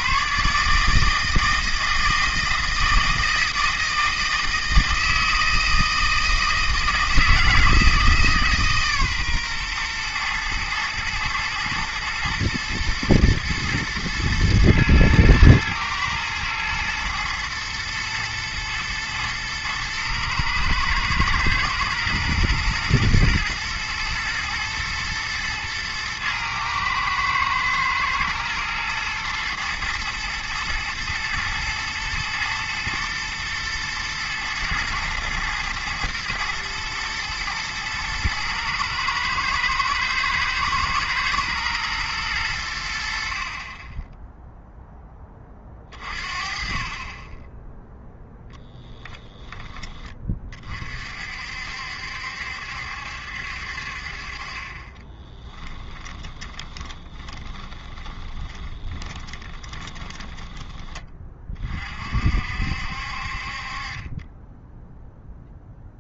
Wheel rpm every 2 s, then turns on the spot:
150, 160, 160, 160, 140, 110, 120, 120, 120, 120, 110, 120, 110, 110, 120, 110, 110, 120, 120, 110, 110, 80, 0, 30, 10, 40, 70, 30, 20, 20, 20, 60, 0.
48-50 56-60